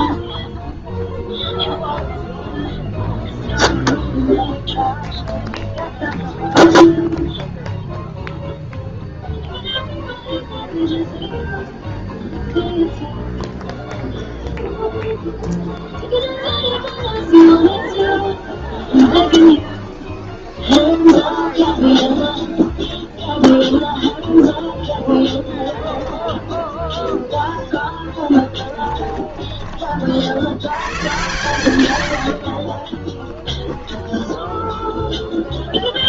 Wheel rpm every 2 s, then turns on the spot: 0, 0, 0, 0, 0, 0, 0, 0, 0, 0, 0, 10, 10, 0, 10, 110, 40, 0.
28-30 32-34